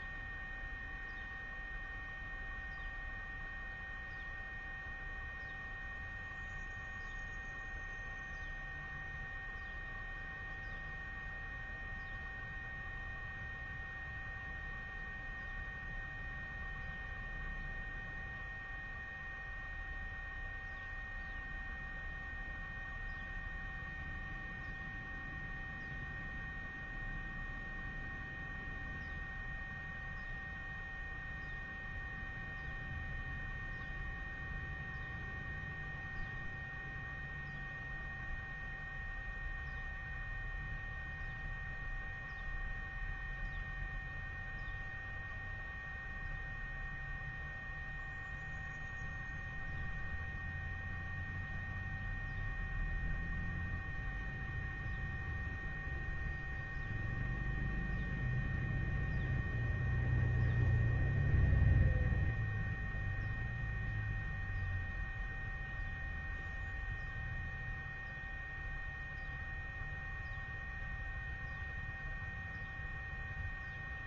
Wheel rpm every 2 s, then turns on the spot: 0, 0, 0, 0, 0, 0, 0, 0, 0, 0, 0, 0, 0, 0, 0, 0, 0, 0, 0, 0, 0, 0, 0, 0, 0, 0, 0, 0, 0, 0, 0, 0, 0, 0, 0, 0, 0.
none